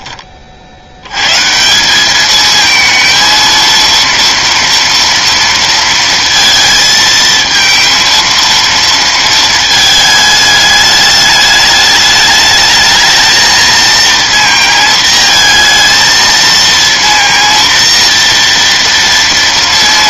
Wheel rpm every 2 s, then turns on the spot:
80, 220, 230, 230, 230, 210, 210, 230, 230, 230.
none